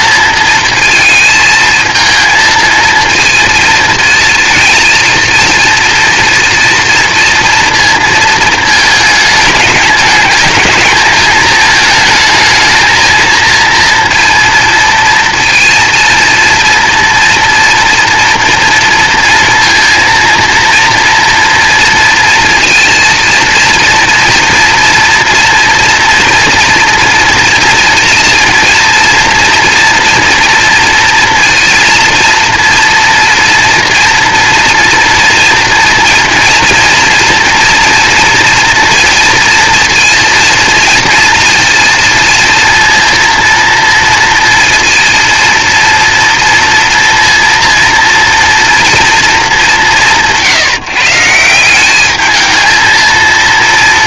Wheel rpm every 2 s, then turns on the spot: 230, 230, 230, 230, 220, 220, 220, 230, 230, 230, 230, 230, 230, 230, 230, 230, 230, 230, 230, 230, 230, 230, 240, 230, 230, 160, 220.
none